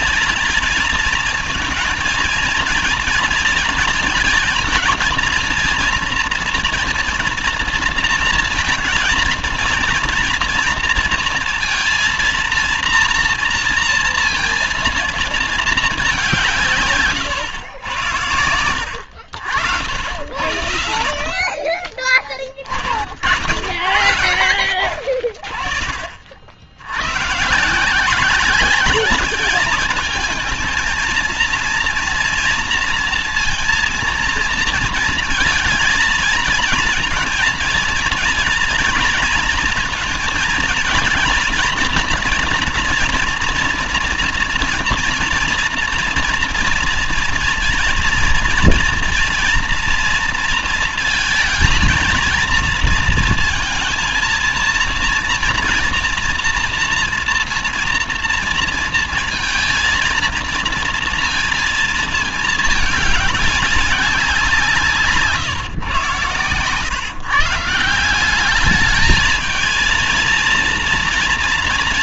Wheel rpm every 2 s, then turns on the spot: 230, 220, 230, 230, 230, 230, 230, 230, 140, 90, 70, 50, 50, 100, 200, 220, 230, 230, 230, 230, 220, 230, 230, 230, 240, 220, 230, 230, 230, 230, 230, 210, 160, 130, 210, 230.
none